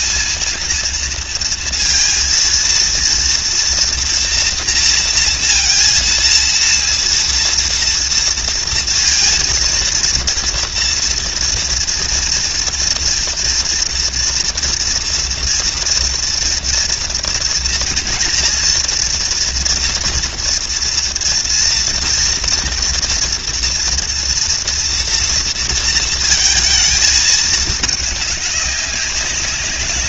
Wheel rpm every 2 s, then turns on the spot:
230, 230, 230, 230, 230, 230, 230, 230, 230, 240, 230, 230, 230, 220, 190.
none